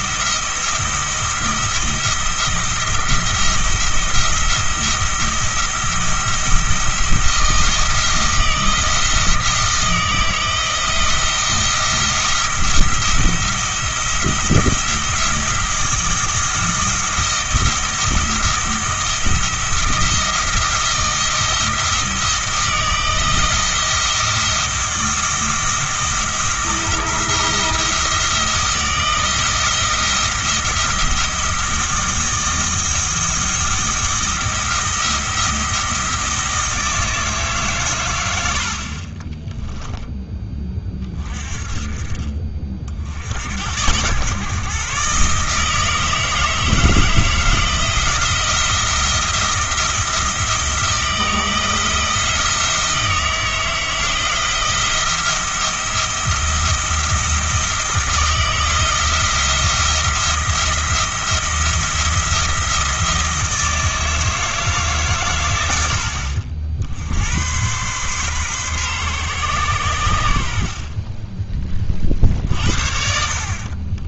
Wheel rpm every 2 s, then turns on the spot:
170, 170, 170, 170, 170, 170, 170, 170, 170, 170, 170, 160, 160, 170, 170, 170, 160, 170, 160, 60, 20, 40, 140, 160, 170, 170, 160, 170, 170, 160, 170, 170, 160, 60, 130, 50, 60.
none